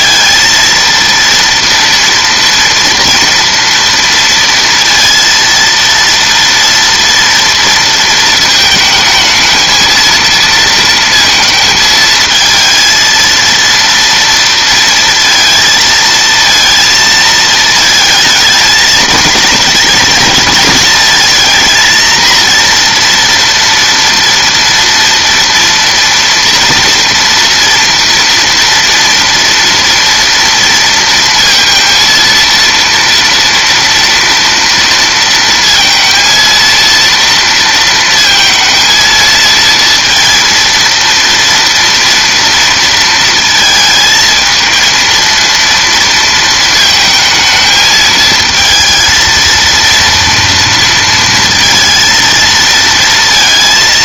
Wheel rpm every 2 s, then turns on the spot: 230, 230, 230, 230, 220, 230, 230, 230, 230, 220, 230, 240, 230, 230, 230, 230, 230, 230, 230, 220, 230, 230, 230, 220, 220, 230, 230.
none